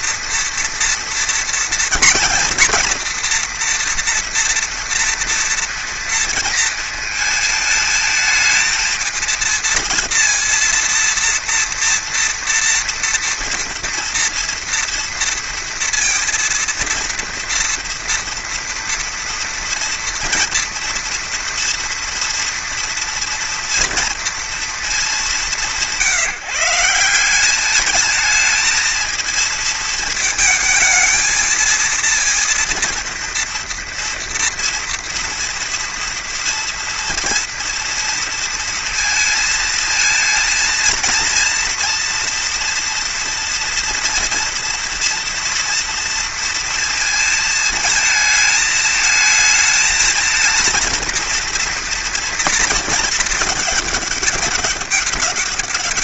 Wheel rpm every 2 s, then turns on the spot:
230, 230, 230, 220, 220, 230, 230, 230, 230, 230, 230, 230, 200, 170, 230, 220, 230, 230, 230, 230, 230, 240, 230, 230, 220, 230, 220, 200.
none